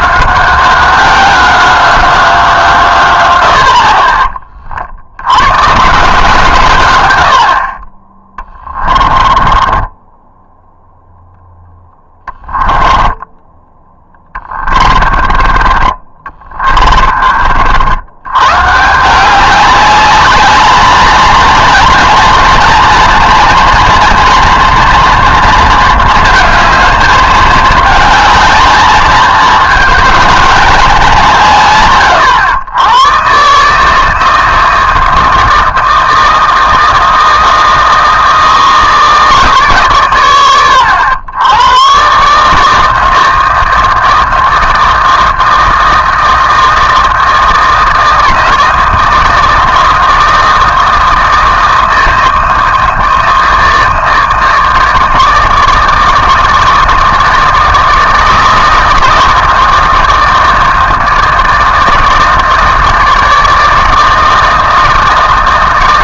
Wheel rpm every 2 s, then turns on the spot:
190, 150, 50, 130, 20, 0, 10, 20, 30, 130, 210, 230, 230, 220, 220, 220, 110, 160, 160, 160, 110, 150, 160, 160, 160, 160, 160, 160, 160, 160, 160, 160, 160.
8-10 12-18